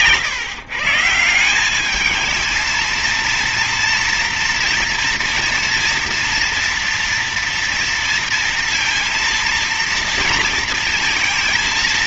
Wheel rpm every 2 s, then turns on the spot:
130, 220, 240, 230, 230, 230.
none